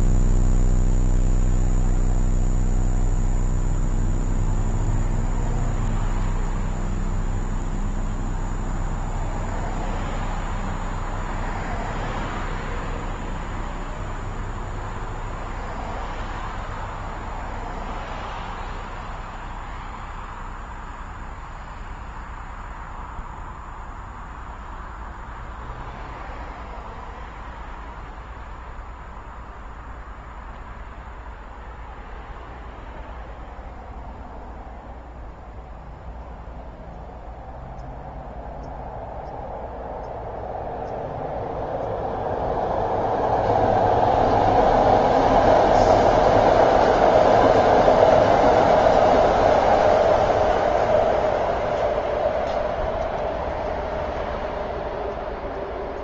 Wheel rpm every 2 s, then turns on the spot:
0, 0, 0, 0, 0, 0, 0, 0, 0, 0, 0, 0, 0, 0, 0, 0, 0, 0, 0, 0, 0, 0, 0, 0, 0, 0, 0, 0.
none